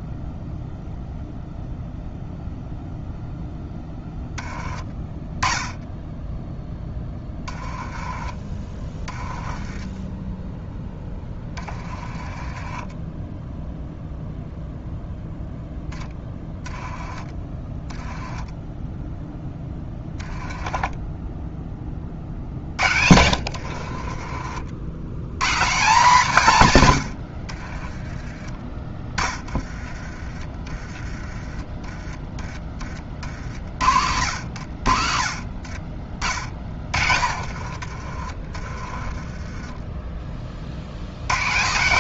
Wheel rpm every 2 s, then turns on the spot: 0, 0, 20, 10, 20, 10, 20, 0, 10, 10, 10, 60, 70, 130, 20, 20, 30, 70, 30, 30, 70.
6-10 12-14 16-18 20-24 36-40